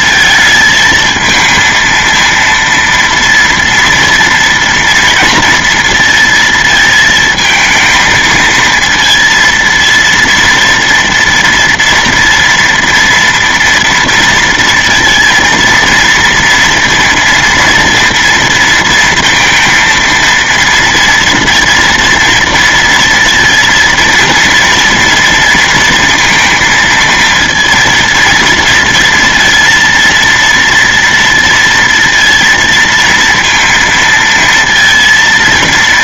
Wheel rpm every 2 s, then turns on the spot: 220, 230, 230, 220, 230, 230, 230, 230, 230, 230, 230, 230, 230, 230, 230, 230, 230, 230.
none